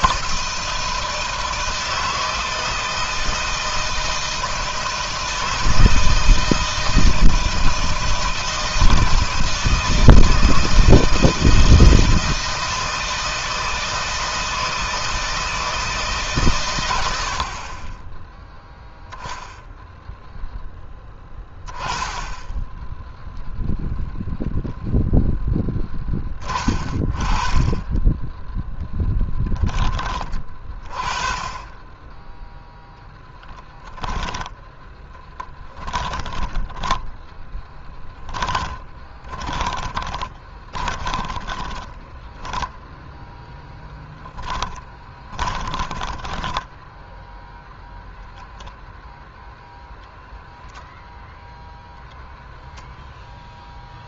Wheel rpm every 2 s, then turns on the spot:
160, 160, 160, 160, 160, 160, 160, 160, 120, 0, 10, 10, 0, 10, 10, 20, 0, 10, 10, 20, 20, 0, 20, 10, 0, 0, 0.
34-42 44-48